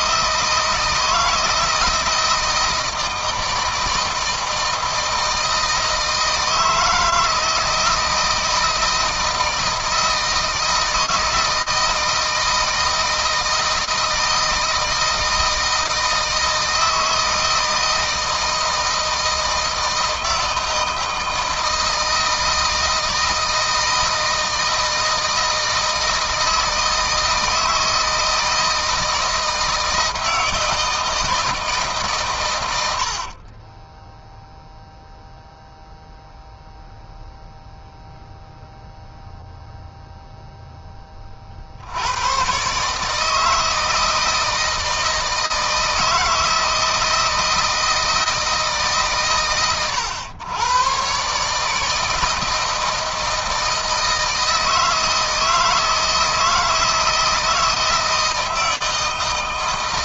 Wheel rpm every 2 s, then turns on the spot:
160, 160, 160, 160, 160, 160, 160, 160, 160, 160, 160, 160, 160, 160, 160, 160, 90, 0, 0, 0, 10, 140, 160, 160, 140, 130, 160, 160, 160, 160.
32-34